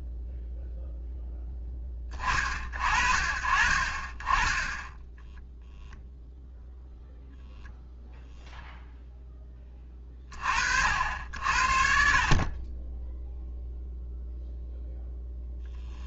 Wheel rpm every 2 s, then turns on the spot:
10, 40, 0, 0, 20, 60, 0, 10.
14-16